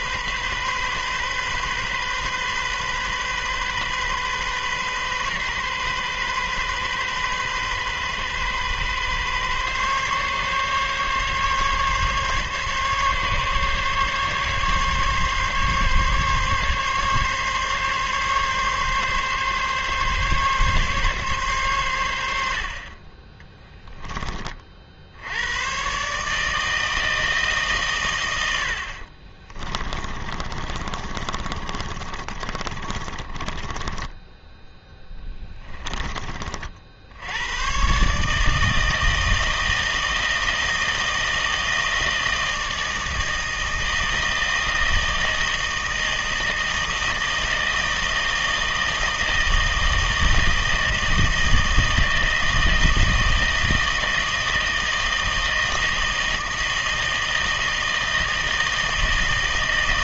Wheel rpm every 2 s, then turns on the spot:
130, 130, 130, 130, 130, 140, 140, 140, 140, 140, 140, 60, 50, 160, 70, 30, 30, 10, 50, 160, 160, 160, 160, 160, 160, 160, 160, 160, 160, 160.
30-36